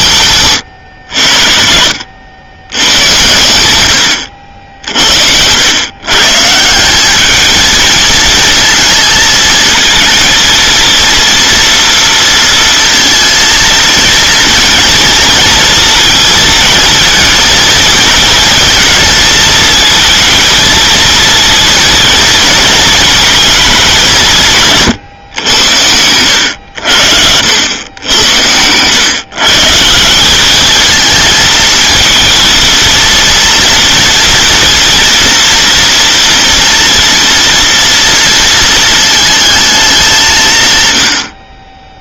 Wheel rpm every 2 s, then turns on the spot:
110, 110, 70, 160, 230, 230, 230, 230, 230, 220, 220, 220, 150, 80, 100, 210, 230, 230, 230, 230, 140.
none